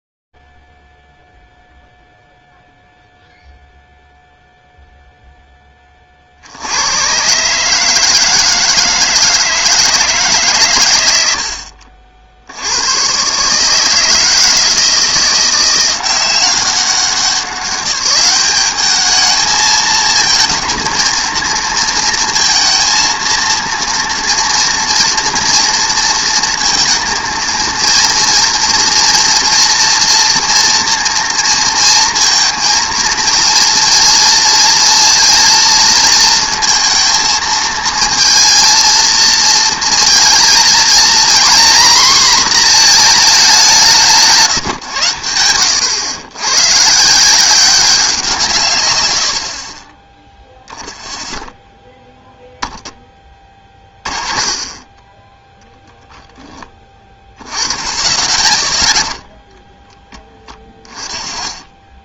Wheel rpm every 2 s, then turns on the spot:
0, 0, 0, 100, 160, 120, 90, 160, 190, 210, 230, 230, 230, 230, 230, 230, 230, 230, 230, 230, 230, 230, 120, 140, 130, 0, 10, 20, 10, 10, 30.
60-62